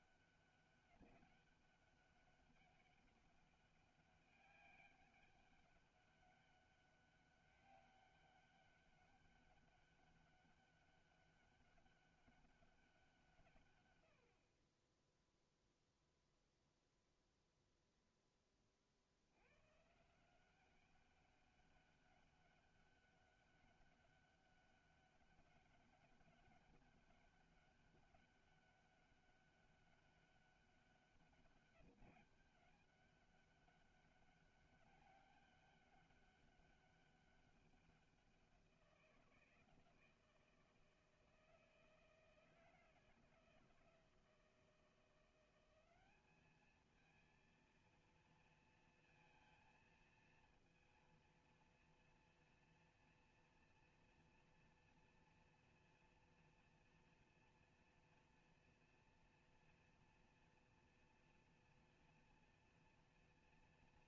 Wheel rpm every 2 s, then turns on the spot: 190, 200, 200, 200, 200, 200, 200, 60, 0, 10, 180, 200, 200, 200, 200, 200, 200, 200, 200, 180, 160, 160, 170, 210, 230, 230, 240, 230, 230, 240, 240, 230.
none